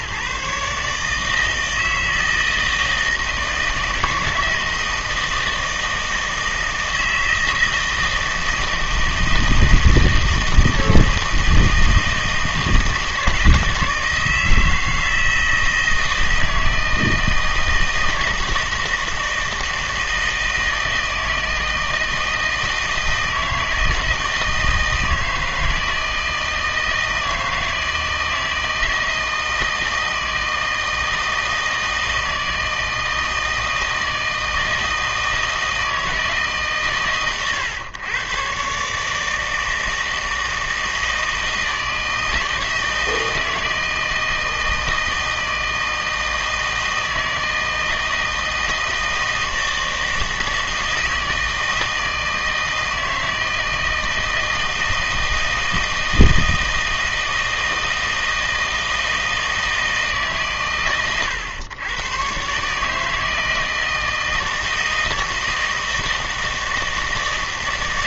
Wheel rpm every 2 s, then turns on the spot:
140, 160, 160, 160, 160, 160, 160, 160, 160, 160, 160, 160, 160, 160, 160, 160, 160, 160, 140, 140, 160, 160, 160, 160, 160, 160, 160, 160, 160, 160, 130, 140, 160, 160.
none